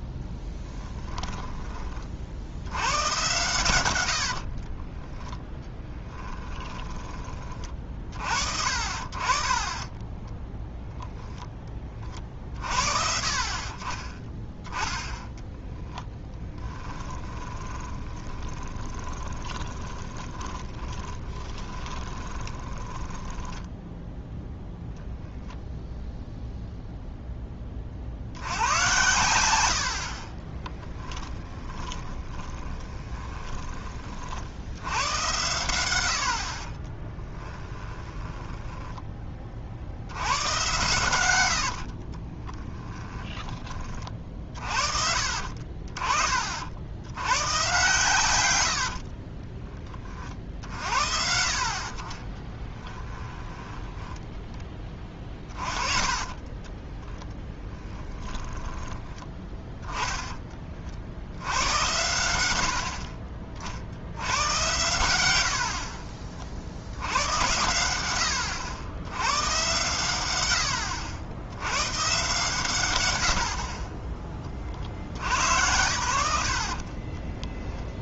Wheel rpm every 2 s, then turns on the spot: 10, 90, 30, 10, 50, 0, 40, 10, 10, 20, 20, 20, 0, 0, 100, 30, 20, 80, 40, 10, 110, 20, 60, 60, 90, 50, 10, 10, 20, 20, 30, 90, 100, 70, 90, 80, 120, 40, 40.
0-2 4-8 16-24 30-34 38-40 42-44 52-54 56-58